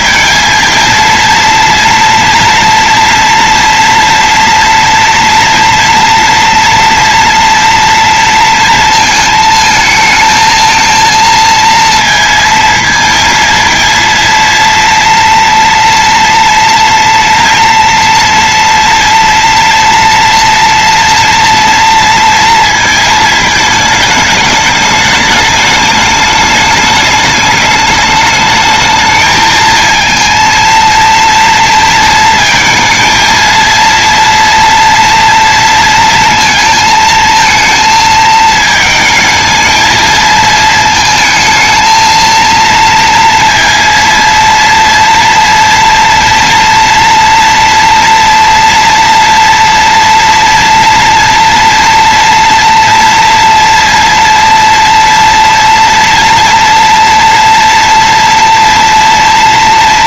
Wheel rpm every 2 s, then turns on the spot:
230, 230, 230, 230, 230, 230, 230, 230, 230, 230, 230, 230, 210, 210, 220, 230, 230, 230, 220, 220, 220, 230, 230, 230, 230, 230, 230, 230, 230, 230.
none